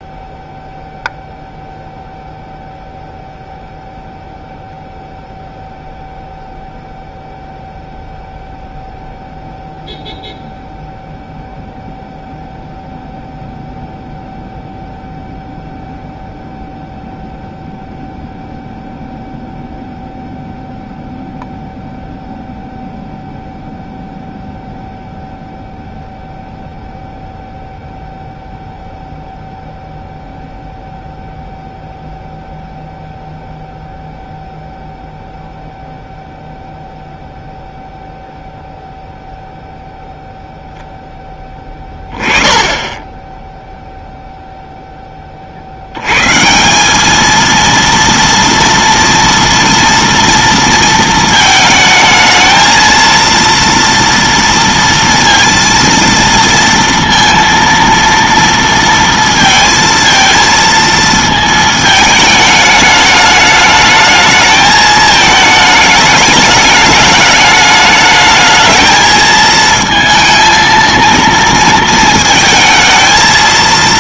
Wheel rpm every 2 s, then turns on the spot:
0, 0, 0, 0, 0, 0, 0, 0, 0, 0, 0, 0, 0, 0, 0, 0, 0, 0, 0, 0, 0, 10, 0, 50, 230, 230, 220, 230, 230, 230, 230, 220, 210, 220, 210, 220, 230.
none